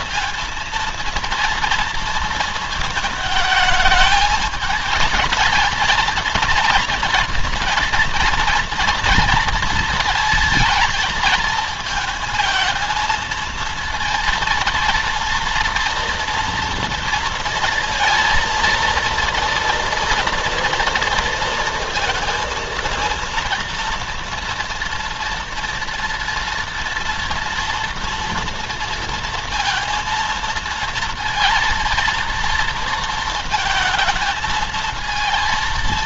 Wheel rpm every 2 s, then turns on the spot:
230, 220, 220, 230, 230, 230, 230, 230, 230, 230, 230, 230, 230, 230, 230, 230, 230, 220.
none